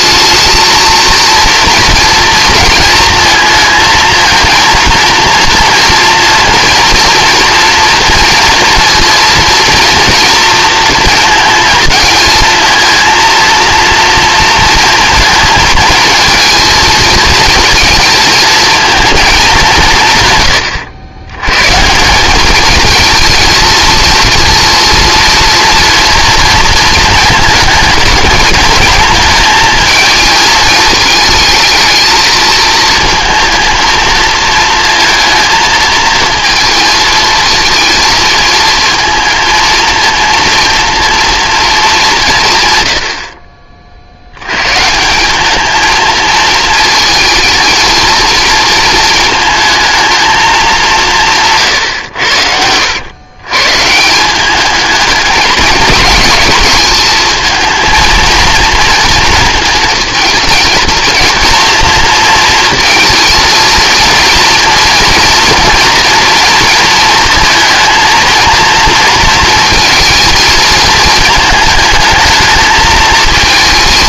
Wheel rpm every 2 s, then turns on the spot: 230, 230, 230, 230, 230, 230, 230, 230, 230, 220, 110, 220, 230, 230, 220, 210, 220, 230, 220, 230, 230, 110, 140, 220, 230, 200, 90, 210, 220, 230, 230, 220, 230, 230, 230, 220, 220.
none